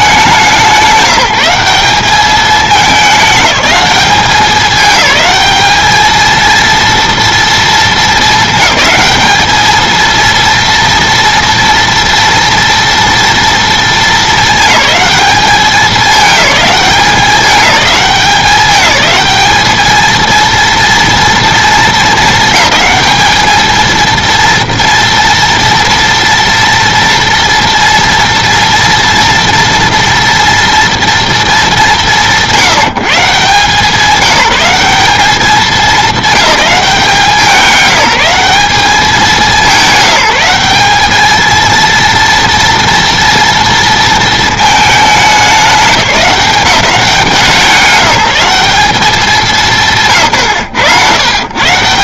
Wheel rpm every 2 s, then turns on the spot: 180, 210, 210, 230, 210, 230, 230, 220, 200, 210, 230, 200, 230, 230, 230, 240, 170, 190, 190, 200, 200, 230, 220, 190, 200, 120.
none